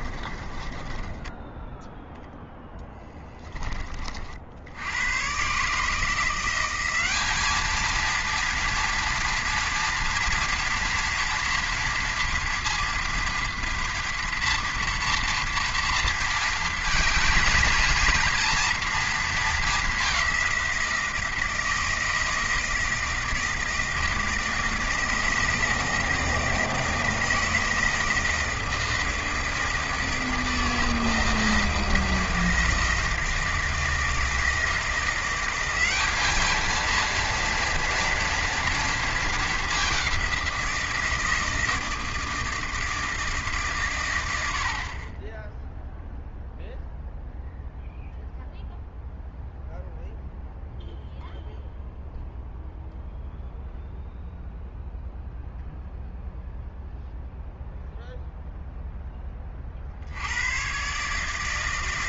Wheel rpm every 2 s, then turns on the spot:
20, 10, 60, 180, 230, 230, 230, 230, 230, 230, 180, 160, 160, 160, 160, 160, 160, 160, 220, 230, 180, 160, 70, 0, 0, 0, 0, 0, 0, 0, 110.
0-2